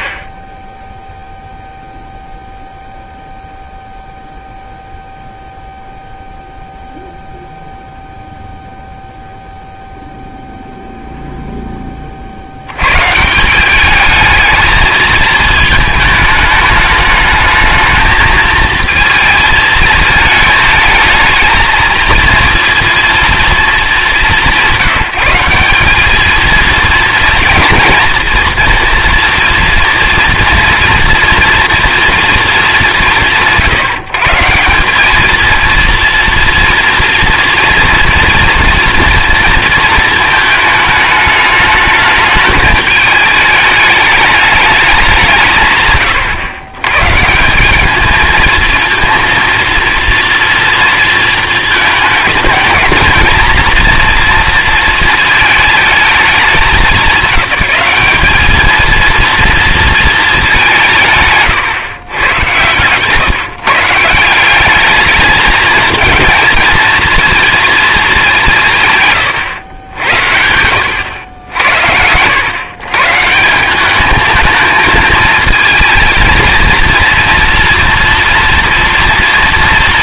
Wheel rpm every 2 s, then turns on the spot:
10, 0, 0, 0, 0, 10, 190, 220, 210, 220, 220, 220, 190, 230, 230, 240, 130, 230, 230, 230, 210, 210, 140, 180, 230, 220, 230, 220, 210, 230, 150, 150, 220, 230, 100, 90, 180, 230, 230, 230.
none